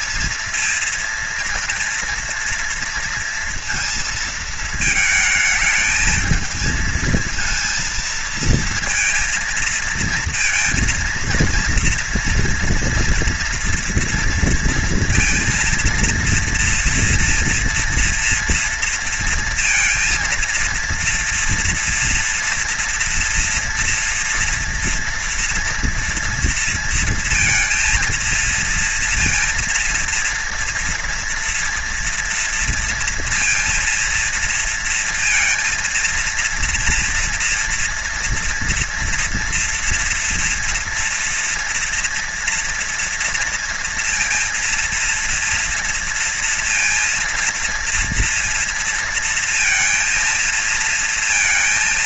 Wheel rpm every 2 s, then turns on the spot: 230, 230, 220, 220, 230, 230, 230, 240, 230, 230, 230, 240, 230, 230, 230, 230, 230, 230, 230, 230, 240, 240, 230, 230, 230, 230.
none